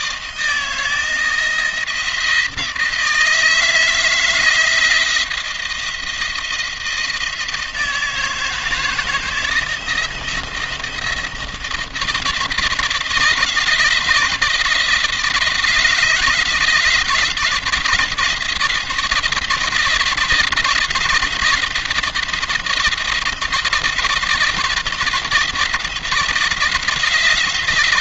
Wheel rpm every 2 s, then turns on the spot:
160, 160, 160, 170, 160, 170, 160, 170, 160, 170, 170, 170, 170, 170.
none